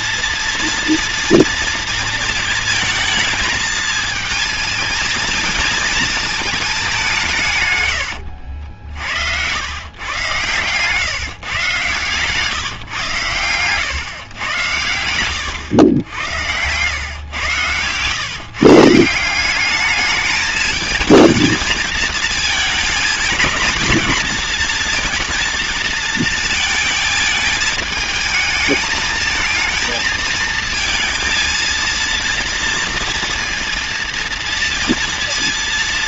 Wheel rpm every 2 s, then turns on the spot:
230, 220, 220, 200, 70, 140, 130, 110, 120, 160, 220, 220, 230, 220, 220, 220, 230, 230.
none